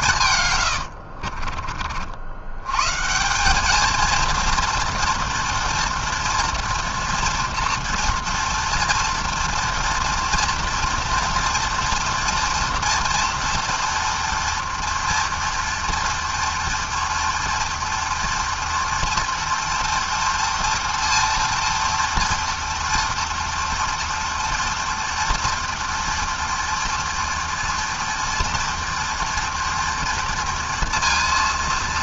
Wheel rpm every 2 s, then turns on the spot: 40, 170, 240, 230, 230, 230, 230, 230, 230, 230, 230, 230, 230, 230, 230, 230.
0-2